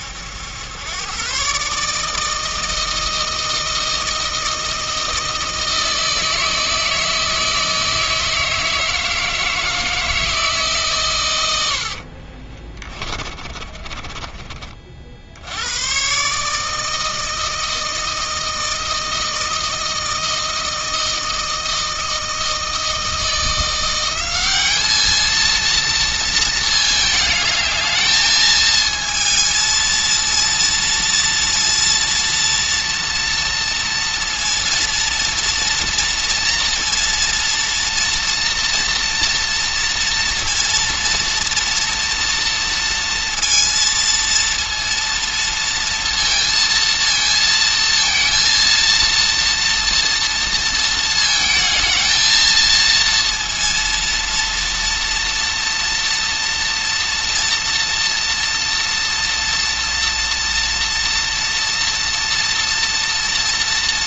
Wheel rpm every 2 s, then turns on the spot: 110, 160, 160, 160, 160, 130, 30, 40, 160, 160, 160, 160, 210, 220, 220, 230, 230, 230, 230, 230, 230, 230, 230, 230, 230, 230, 230, 230, 240, 230, 230, 230.
12-14